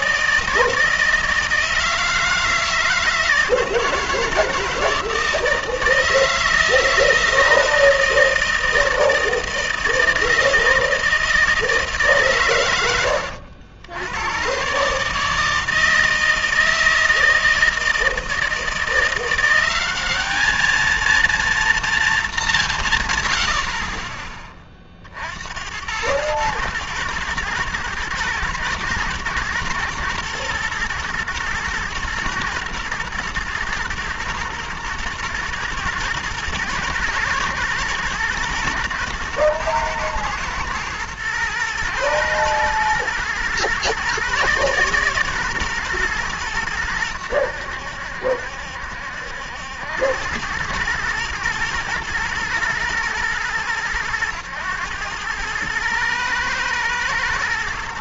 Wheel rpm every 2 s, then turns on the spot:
160, 160, 160, 160, 160, 160, 110, 130, 160, 160, 210, 180, 20, 110, 110, 120, 120, 110, 110, 110, 110, 110, 140, 110, 70, 100, 120, 100, 110.
none